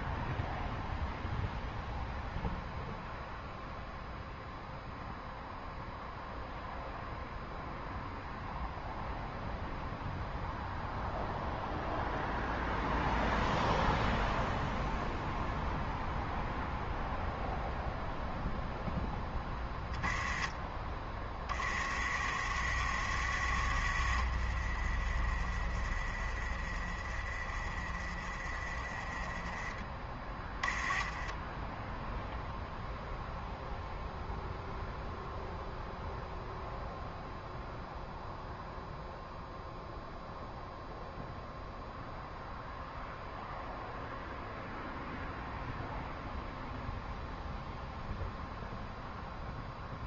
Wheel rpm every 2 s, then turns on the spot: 0, 0, 0, 0, 0, 0, 0, 0, 0, 0, 20, 50, 30, 20, 20, 10, 0, 0, 0, 0, 0, 0, 0, 0, 0.
none